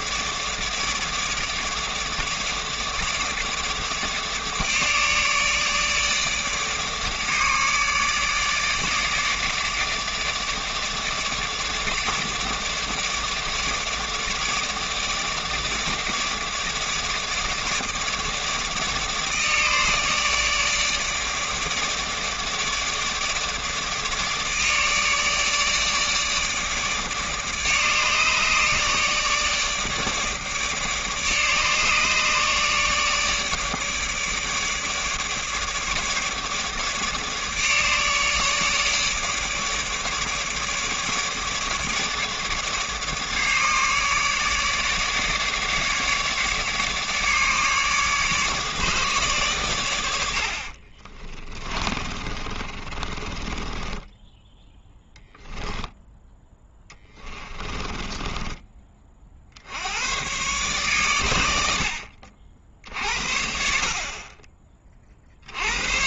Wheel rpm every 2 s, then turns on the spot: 150, 150, 150, 150, 150, 150, 150, 150, 150, 150, 150, 150, 150, 150, 150, 150, 150, 150, 150, 150, 150, 150, 150, 150, 150, 40, 30, 10, 10, 20, 130, 60, 30.
50-58